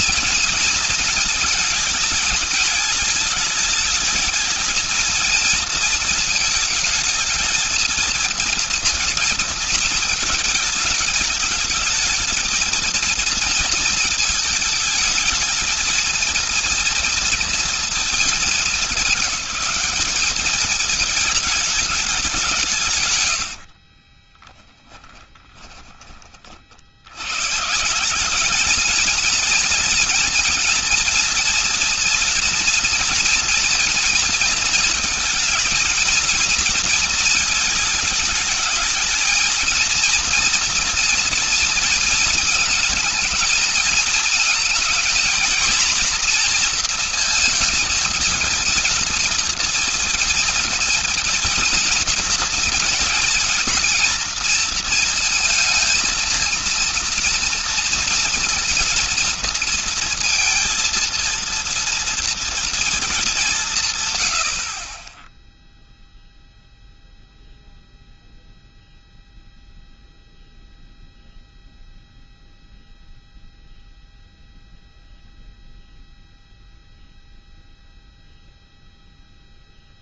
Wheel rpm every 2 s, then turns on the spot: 230, 220, 220, 220, 230, 220, 230, 220, 230, 220, 210, 160, 10, 60, 220, 230, 240, 230, 230, 210, 230, 230, 220, 230, 230, 240, 230, 230, 230, 230, 230, 230, 40, 0, 0, 0, 0, 0, 0, 0.
24-26